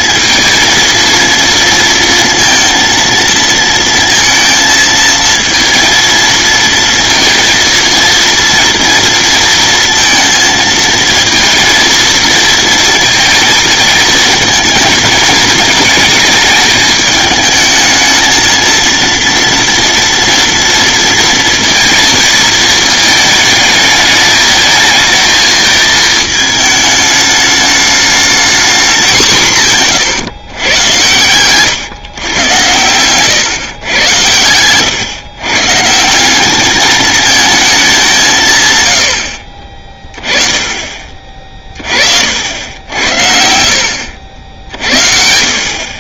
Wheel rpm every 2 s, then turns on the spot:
230, 230, 230, 230, 230, 230, 230, 220, 210, 230, 230, 220, 220, 220, 210, 120, 110, 110, 210, 110, 30, 80, 70.
32-34